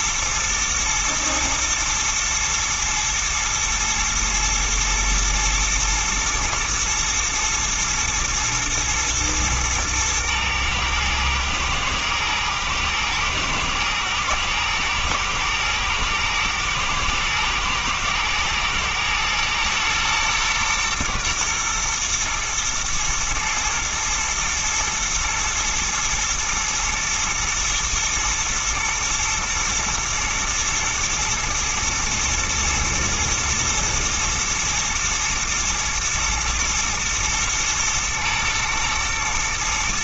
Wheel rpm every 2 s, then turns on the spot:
110, 120, 110, 110, 120, 120, 110, 110, 110, 120, 120, 120, 110, 120, 110, 110, 120, 120, 120, 120.
none